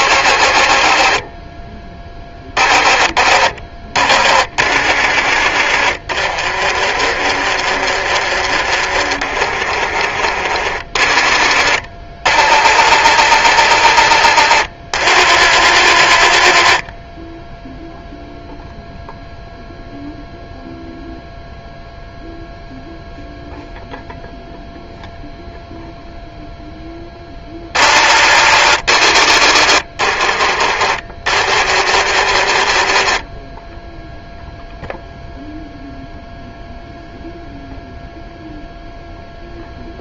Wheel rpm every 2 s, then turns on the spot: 40, 30, 50, 40, 40, 40, 60, 60, 30, 0, 0, 0, 0, 10, 60, 40, 30, 0, 0, 0.
6-10 32-34